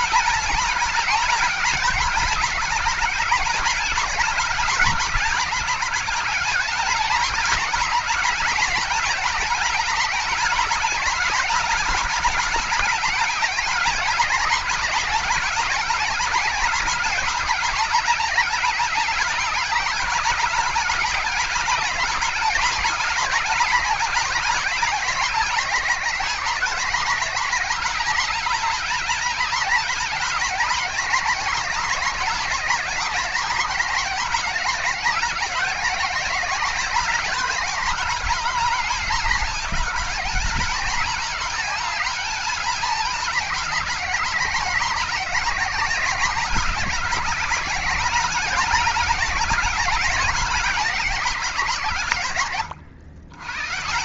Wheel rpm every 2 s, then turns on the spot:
220, 220, 210, 210, 210, 220, 210, 210, 210, 210, 210, 220, 210, 210, 220, 220, 210, 210, 210, 210, 210, 210, 200, 200, 200, 190, 100.
none